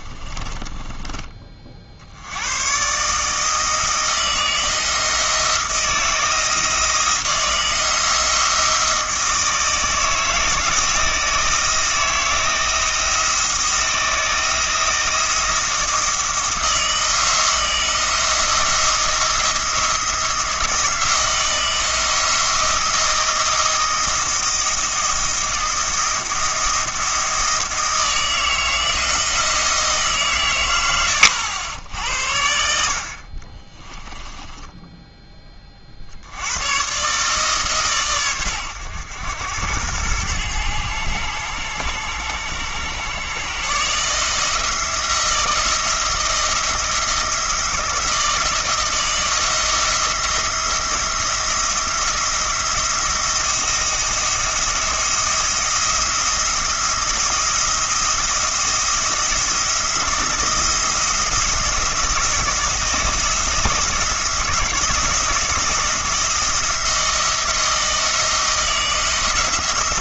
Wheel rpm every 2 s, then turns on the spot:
20, 120, 160, 160, 160, 160, 170, 170, 160, 170, 170, 170, 170, 160, 160, 100, 60, 10, 120, 100, 100, 110, 170, 170, 170, 170, 170, 170, 170, 170, 170, 170, 170, 170, 160.
0-2 34-36